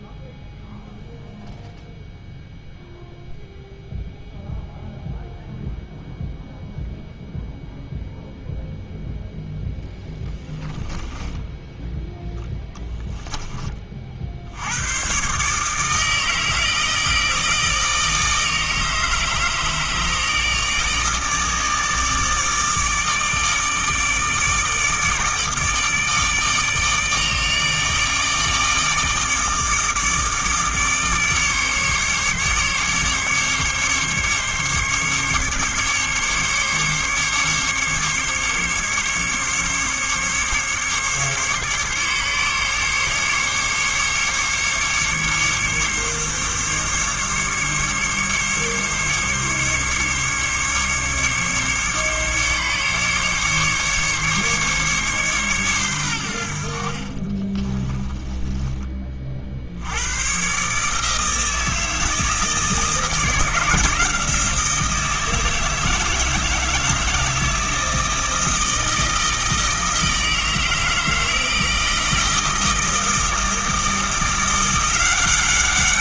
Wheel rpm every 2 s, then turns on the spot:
0, 0, 0, 0, 0, 10, 10, 80, 160, 160, 150, 160, 160, 160, 150, 150, 140, 140, 140, 140, 140, 140, 140, 140, 140, 140, 140, 140, 60, 10, 130, 160, 170, 160, 160, 160, 160, 170.
10-14 58-60